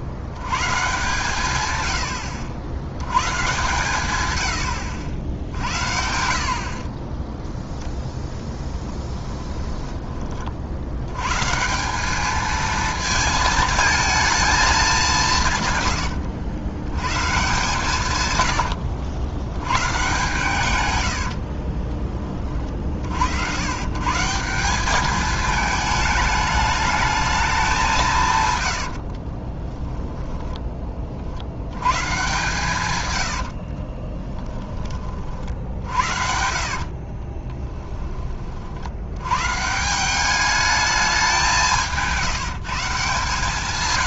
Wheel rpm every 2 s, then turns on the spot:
130, 90, 90, 40, 10, 70, 220, 210, 110, 80, 110, 40, 190, 210, 90, 30, 130, 20, 70, 60, 210, 160.
8-10 18-20 28-30 36-38